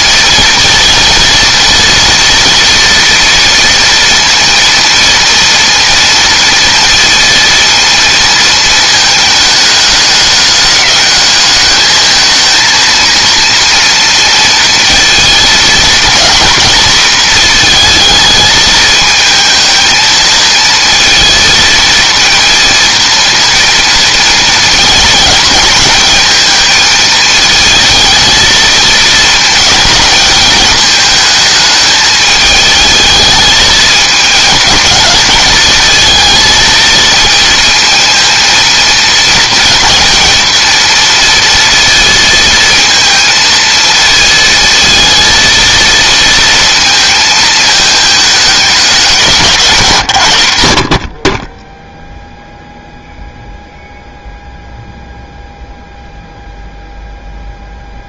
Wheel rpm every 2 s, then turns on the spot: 230, 230, 230, 230, 220, 210, 230, 230, 230, 220, 230, 230, 210, 220, 220, 220, 220, 220, 230, 230, 230, 220, 230, 220, 180, 30, 0, 0, 0.
none